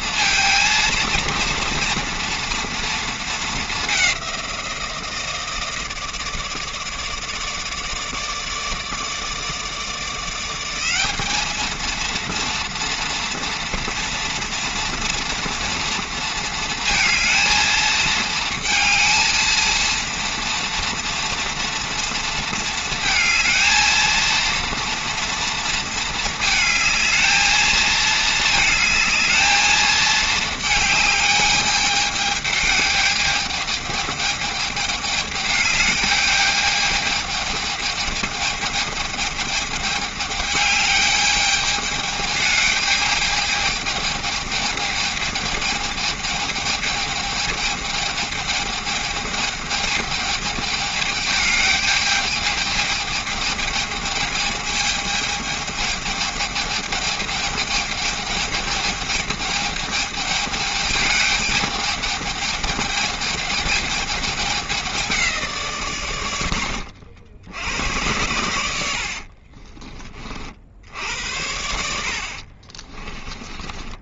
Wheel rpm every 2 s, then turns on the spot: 230, 230, 170, 150, 160, 190, 230, 230, 220, 230, 230, 230, 230, 220, 220, 220, 220, 210, 210, 210, 210, 210, 210, 220, 220, 210, 210, 210, 210, 210, 210, 210, 200, 70, 80, 70, 30.
72-74